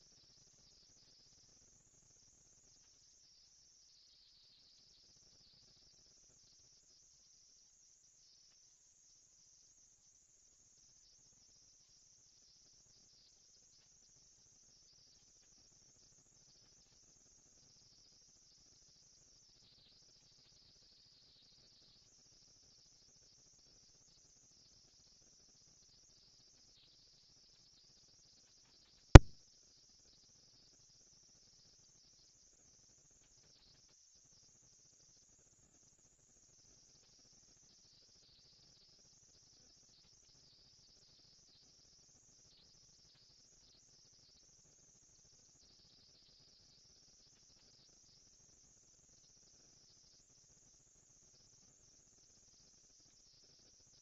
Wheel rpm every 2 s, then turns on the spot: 230, 220, 230, 230, 230, 230, 230, 230, 230, 230, 230, 230, 240, 230, 210, 200, 200, 230, 230, 230, 230, 230, 230, 230, 240, 230, 230.
none